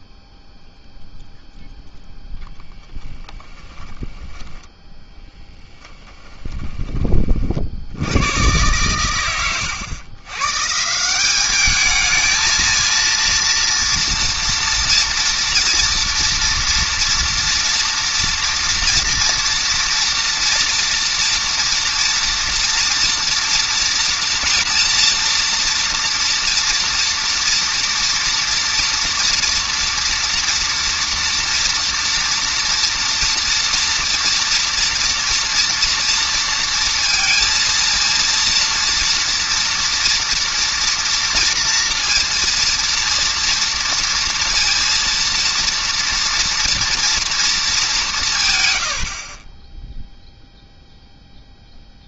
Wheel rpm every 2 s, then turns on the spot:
0, 0, 10, 10, 50, 110, 210, 230, 230, 230, 240, 230, 230, 230, 240, 230, 230, 230, 230, 230, 230, 230, 230, 230, 210, 40.
4-6